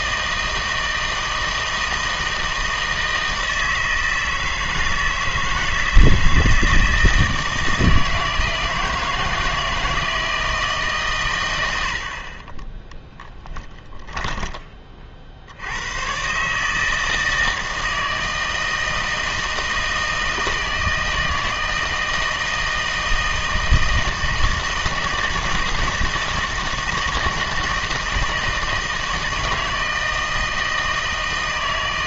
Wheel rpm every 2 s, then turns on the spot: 160, 160, 160, 160, 160, 150, 20, 30, 150, 160, 160, 160, 160, 160, 160, 160.
12-14